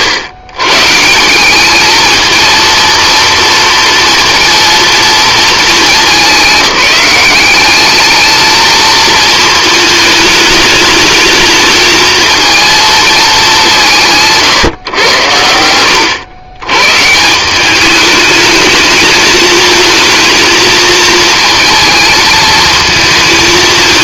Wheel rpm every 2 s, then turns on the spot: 110, 230, 230, 190, 220, 210, 230, 140, 110, 210, 220, 220.
none